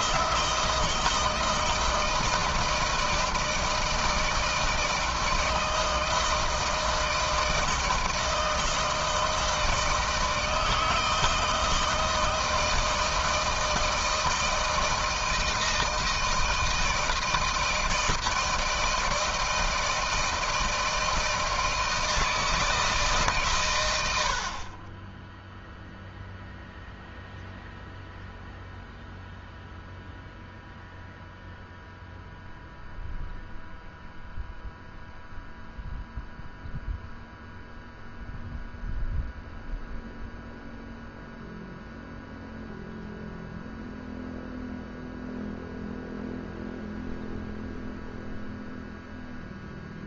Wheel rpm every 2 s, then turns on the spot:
160, 160, 160, 160, 160, 160, 160, 160, 160, 170, 160, 150, 30, 0, 0, 0, 0, 0, 0, 0, 0, 0, 0, 0, 0.
none